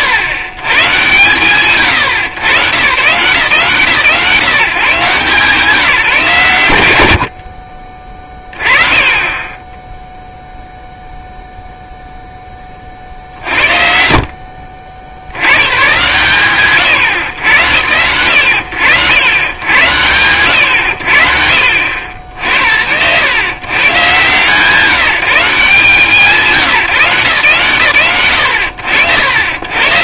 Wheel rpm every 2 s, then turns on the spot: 110, 120, 150, 120, 30, 0, 40, 50, 100, 90, 100, 70, 150, 160, 80.
none